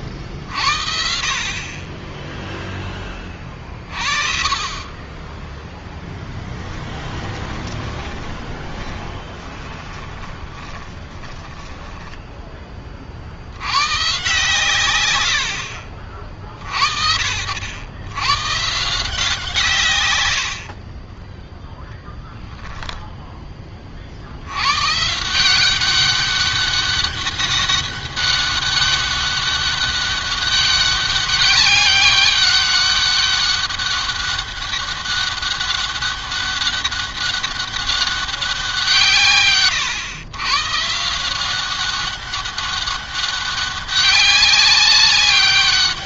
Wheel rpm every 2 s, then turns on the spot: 50, 10, 30, 20, 10, 20, 30, 130, 50, 150, 50, 10, 130, 200, 200, 200, 200, 200, 200, 170, 130, 200, 200.
6-12